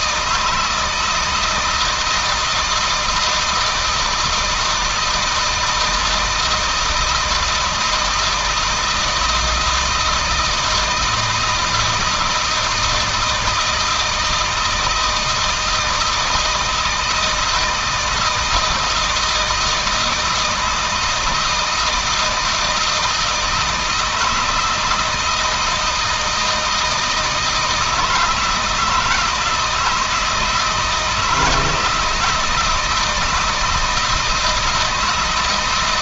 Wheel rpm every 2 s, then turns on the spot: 160, 170, 160, 160, 160, 160, 160, 160, 160, 160, 160, 160, 160, 160, 160, 160, 160, 160.
none